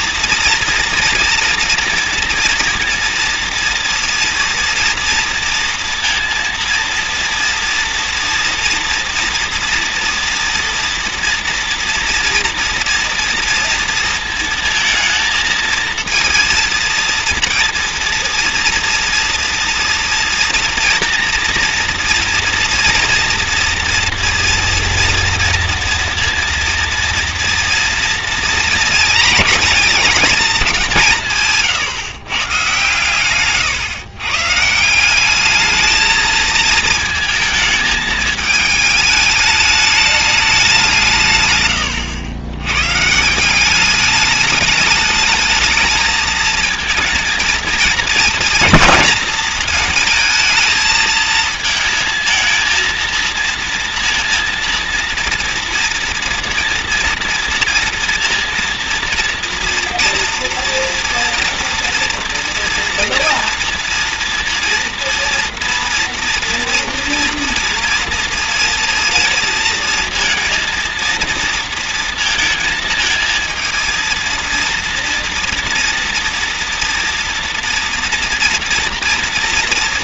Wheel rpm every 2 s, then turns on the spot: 240, 240, 230, 230, 230, 230, 230, 220, 230, 230, 230, 230, 240, 230, 230, 180, 120, 180, 220, 210, 160, 130, 210, 220, 230, 220, 230, 230, 230, 230, 230, 240, 240, 230, 230, 230, 230, 230, 240, 230.
none